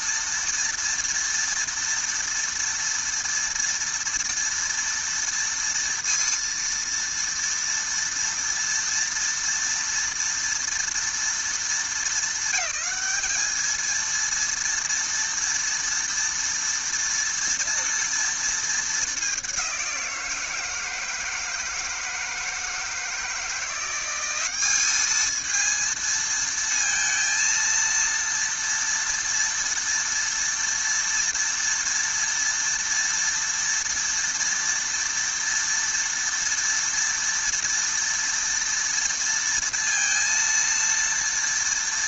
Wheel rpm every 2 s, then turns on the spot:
230, 230, 230, 230, 230, 230, 210, 230, 230, 220, 160, 160, 200, 230, 230, 230, 230, 230, 230, 230, 230.
none